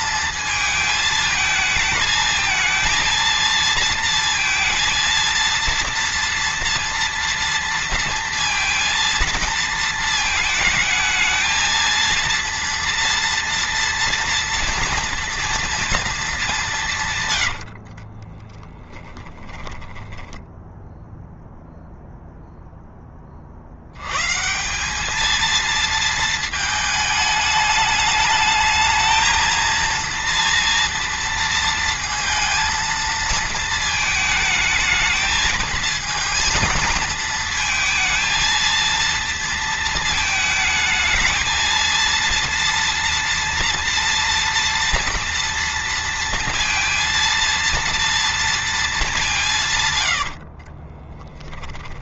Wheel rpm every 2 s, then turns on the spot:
220, 220, 230, 230, 230, 220, 230, 230, 150, 10, 0, 10, 190, 220, 220, 230, 230, 220, 230, 230, 220, 230, 230, 230, 220, 40.
16-18 50-52